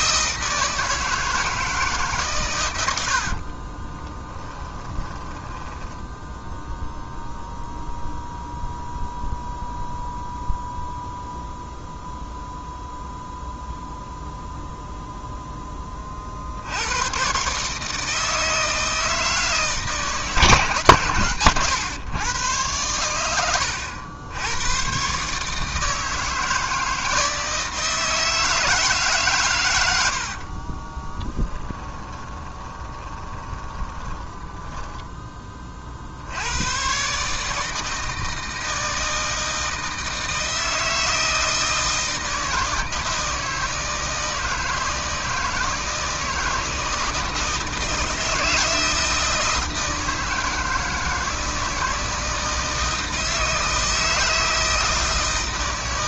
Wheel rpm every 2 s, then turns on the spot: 160, 80, 10, 0, 0, 0, 0, 0, 100, 160, 140, 110, 120, 160, 150, 20, 20, 10, 130, 160, 160, 160, 160, 160, 160, 160, 160, 160.
2-6 30-36